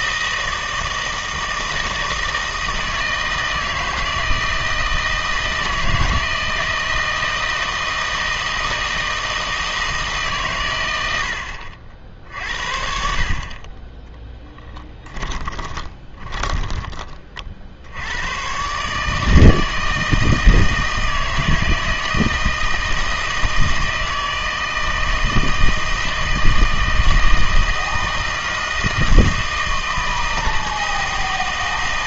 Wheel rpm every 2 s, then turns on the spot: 160, 160, 160, 160, 160, 110, 60, 10, 20, 140, 160, 160, 160, 160, 160, 160.
14-16